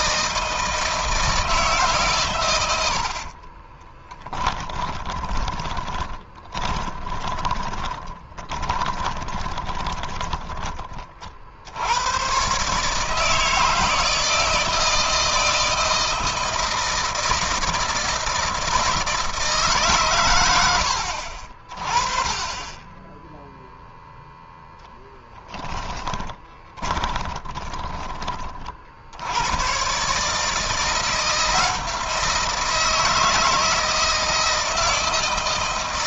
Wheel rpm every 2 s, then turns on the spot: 160, 100, 20, 20, 20, 20, 140, 160, 160, 160, 90, 20, 0, 20, 40, 160, 160, 160.
4-10 26-28